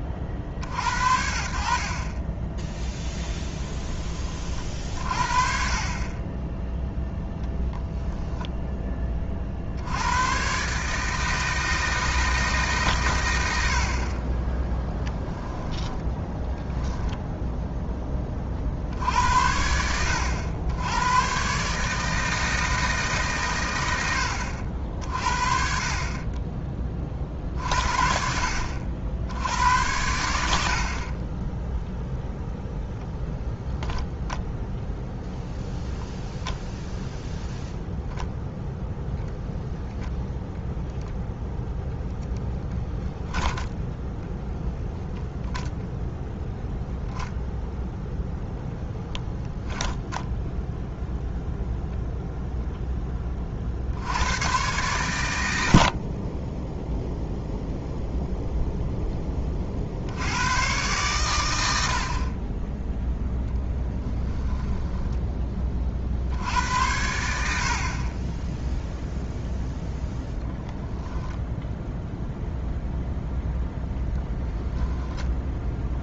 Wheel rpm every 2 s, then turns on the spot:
70, 10, 40, 0, 10, 140, 140, 10, 0, 50, 90, 160, 60, 30, 70, 60, 0, 0, 0, 0, 0, 10, 0, 0, 0, 0, 0, 110, 10, 0, 110, 10, 10, 80, 0, 0, 0, 0.
14-16 64-66